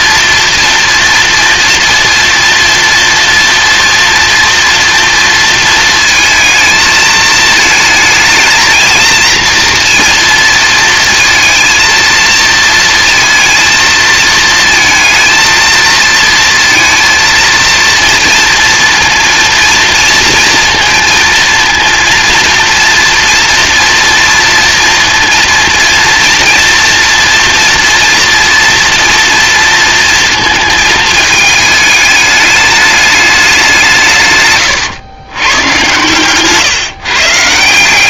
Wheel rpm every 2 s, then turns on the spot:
230, 230, 240, 220, 220, 230, 230, 220, 230, 230, 230, 230, 230, 230, 230, 220, 210, 130, 140.
34-36